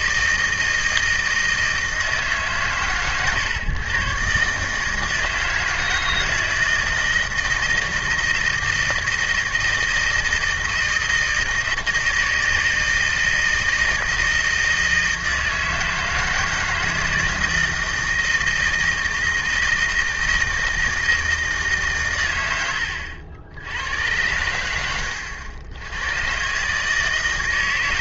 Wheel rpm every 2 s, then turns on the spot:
160, 120, 160, 160, 160, 160, 160, 160, 160, 160, 160, 90, 100, 150.
22-24